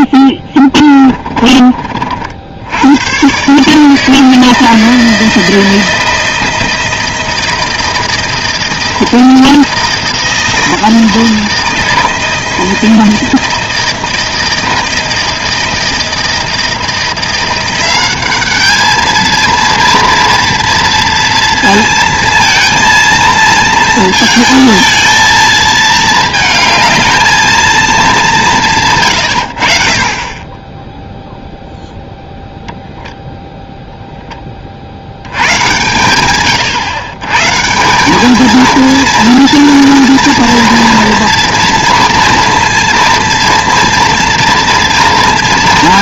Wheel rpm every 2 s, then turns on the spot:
20, 90, 160, 160, 160, 160, 160, 160, 170, 210, 230, 230, 220, 220, 170, 20, 10, 40, 120, 220, 230, 230, 230.
0-2